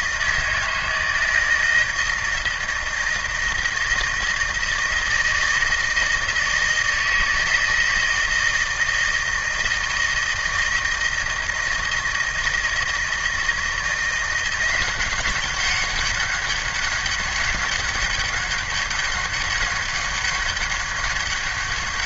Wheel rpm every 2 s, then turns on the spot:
160, 160, 160, 160, 160, 160, 160, 180, 190, 200, 200.
none